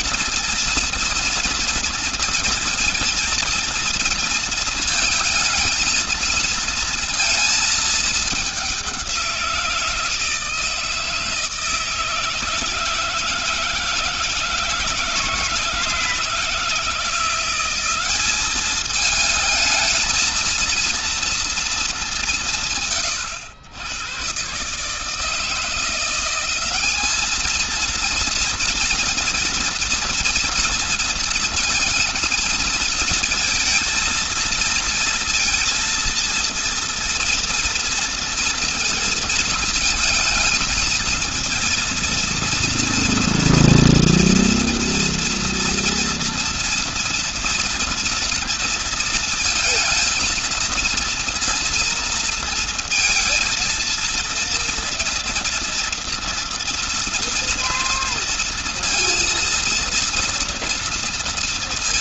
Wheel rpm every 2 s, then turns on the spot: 230, 230, 230, 230, 180, 160, 160, 170, 170, 220, 230, 130, 160, 210, 230, 230, 230, 230, 230, 230, 220, 230, 230, 230, 230, 230, 230, 230, 230, 230, 230.
none